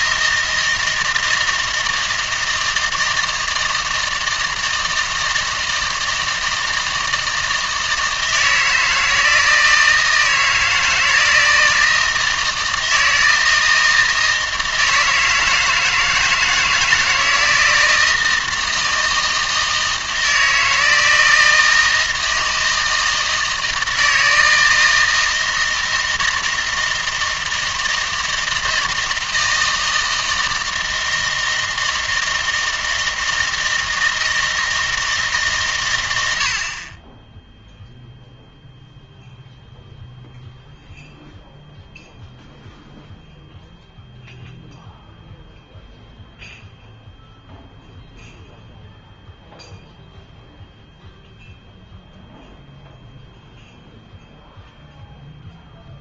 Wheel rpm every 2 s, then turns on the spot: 160, 160, 160, 160, 160, 160, 160, 160, 160, 160, 160, 160, 160, 160, 160, 160, 160, 160, 50, 0, 0, 0, 0, 0, 0, 0, 0, 0.
none